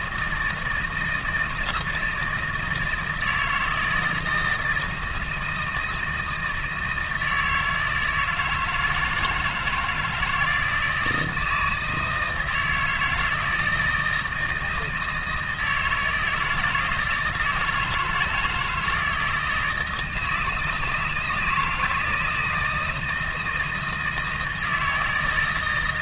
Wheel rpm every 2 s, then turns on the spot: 160, 160, 160, 160, 160, 160, 160, 160, 170, 160, 160, 160, 160.
none